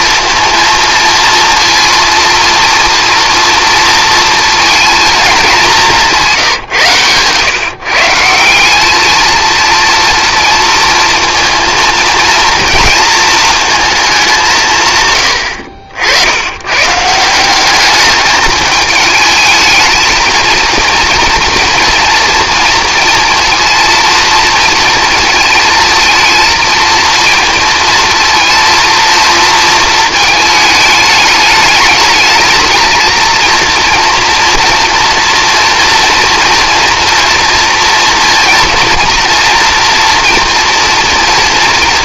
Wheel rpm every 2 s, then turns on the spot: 230, 230, 230, 140, 200, 230, 230, 170, 110, 220, 230, 230, 230, 230, 230, 220, 220, 240, 240, 230, 230.
6-8